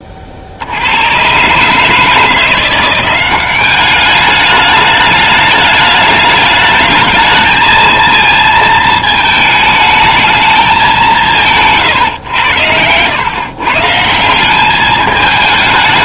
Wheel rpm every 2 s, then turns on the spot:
70, 180, 210, 220, 220, 200, 100, 200.
12-14